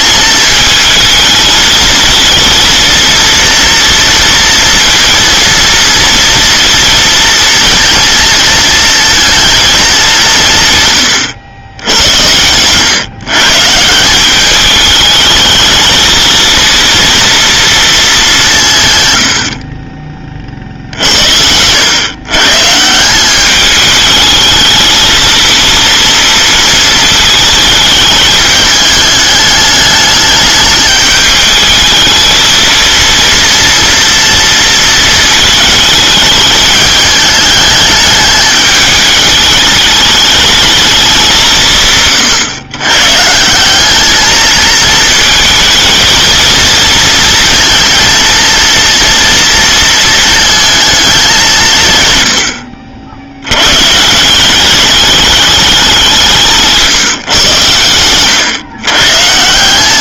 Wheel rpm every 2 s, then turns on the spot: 220, 230, 230, 230, 220, 150, 120, 200, 230, 170, 50, 150, 220, 230, 210, 210, 220, 230, 210, 210, 210, 120, 230, 230, 230, 220, 80, 190, 170, 120.
12-14